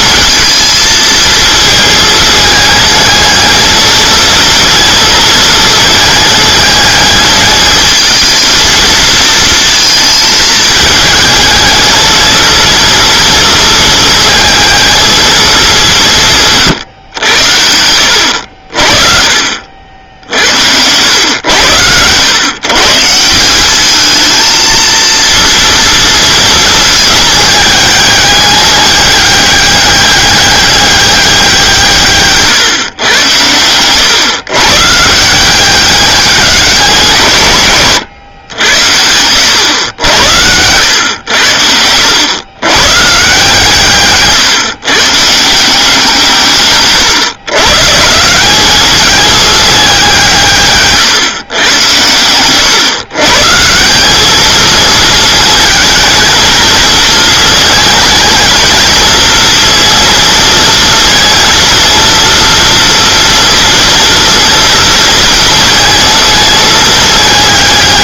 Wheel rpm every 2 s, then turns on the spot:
230, 220, 230, 220, 230, 220, 230, 220, 140, 60, 90, 130, 230, 220, 200, 200, 130, 140, 170, 90, 90, 130, 130, 140, 190, 150, 120, 220, 220, 220, 230, 230, 230, 220.
16-18